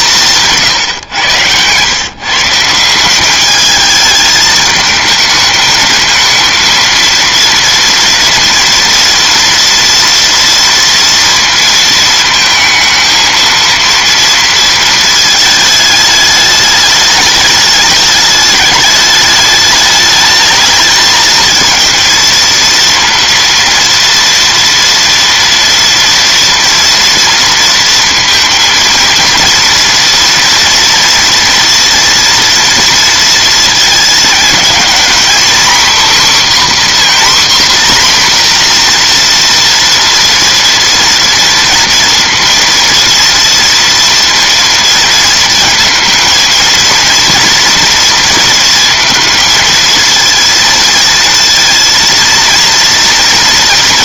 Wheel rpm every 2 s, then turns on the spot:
150, 160, 220, 230, 230, 230, 220, 230, 210, 210, 220, 230, 230, 230, 220, 230, 230, 230, 270, 240, 230, 230, 230, 230, 230, 230, 230.
0-2